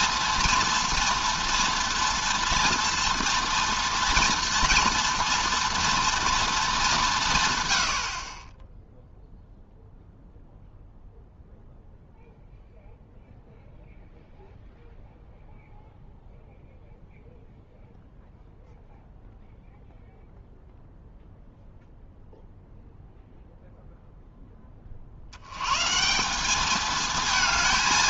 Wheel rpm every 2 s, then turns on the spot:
230, 240, 230, 210, 10, 0, 0, 0, 0, 0, 0, 0, 30, 210.
none